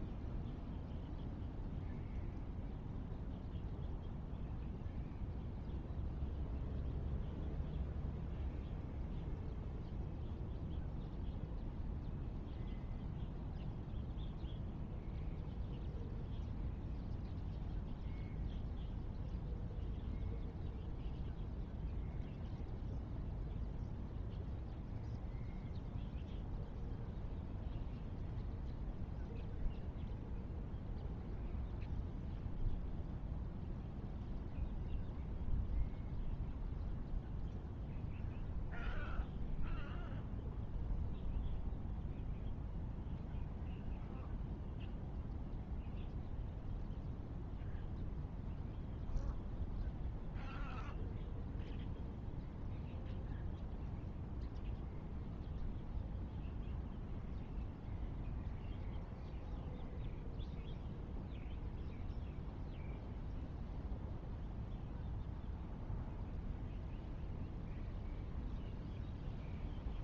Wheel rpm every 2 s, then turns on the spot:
0, 0, 0, 0, 0, 0, 0, 0, 0, 0, 0, 0, 0, 0, 0, 0, 0, 0, 0, 0, 0, 0, 0, 0, 0, 0, 0, 0, 0, 0, 0, 0, 0, 0, 0.
none